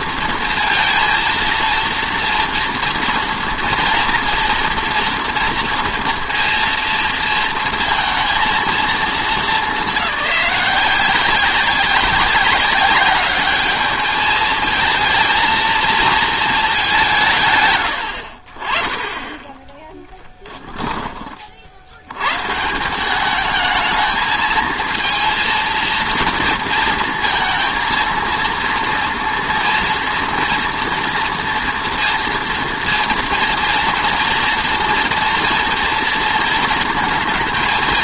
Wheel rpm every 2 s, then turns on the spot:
230, 230, 230, 230, 230, 180, 200, 220, 210, 40, 10, 150, 220, 230, 230, 230, 230, 230, 230.
20-22